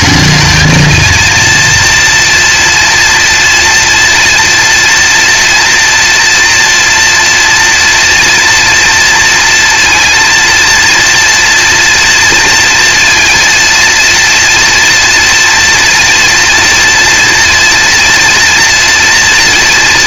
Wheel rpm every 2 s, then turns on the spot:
220, 240, 230, 230, 240, 230, 230, 230, 230, 230.
none